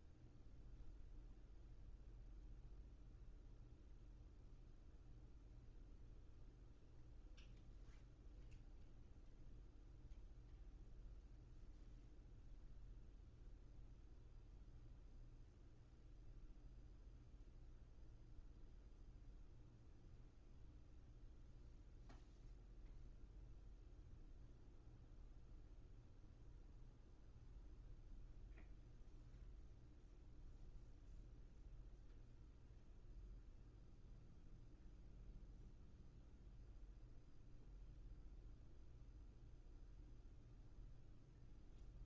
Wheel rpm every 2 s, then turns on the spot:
0, 0, 0, 0, 0, 0, 0, 0, 0, 0, 0, 0, 0, 0, 0, 0, 0, 0, 0, 0, 0.
none